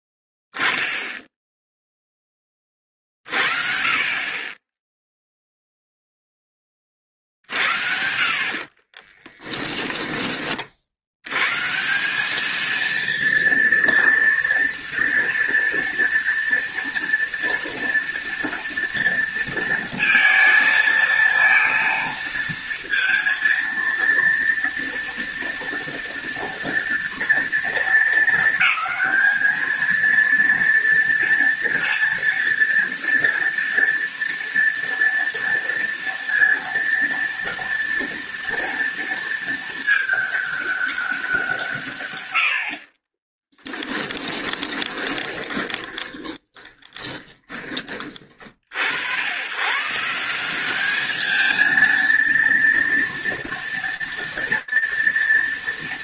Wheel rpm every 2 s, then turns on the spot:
0, 30, 10, 30, 30, 70, 230, 240, 230, 230, 230, 230, 230, 230, 220, 230, 230, 230, 230, 230, 200, 40, 30, 20, 80, 210, 230, 230.
8-10 42-48